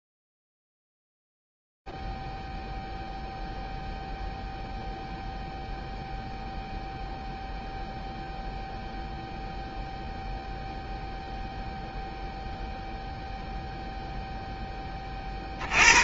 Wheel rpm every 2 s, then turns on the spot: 0, 0, 0, 0, 0, 0, 0, 10.
none